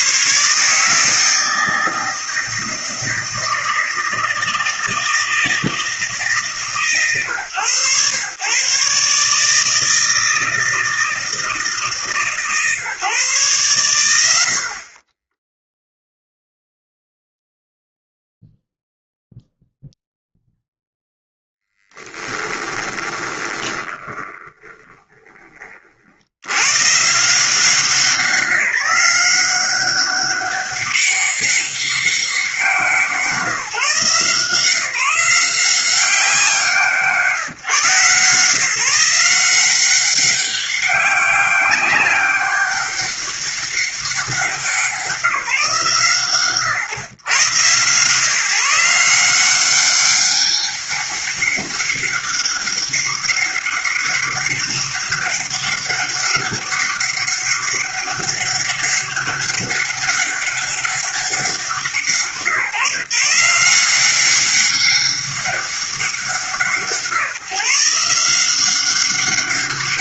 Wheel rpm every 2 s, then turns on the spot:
140, 160, 160, 150, 130, 160, 150, 70, 0, 0, 0, 10, 20, 100, 180, 200, 180, 170, 170, 150, 200, 200, 180, 130, 150, 200, 200, 200, 200, 200, 200, 150, 190, 170, 180.
22-26